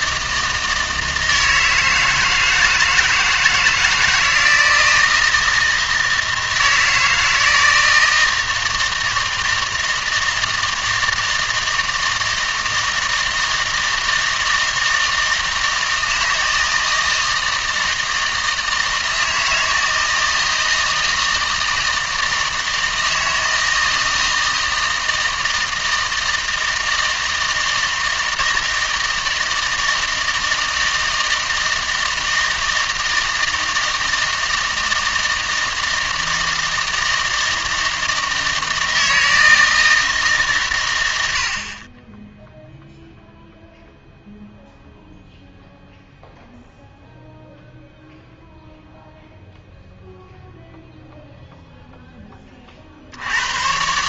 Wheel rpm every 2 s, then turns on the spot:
160, 160, 170, 160, 160, 160, 160, 160, 160, 160, 160, 160, 160, 160, 160, 160, 160, 160, 160, 160, 140, 0, 0, 0, 0, 0, 40.
none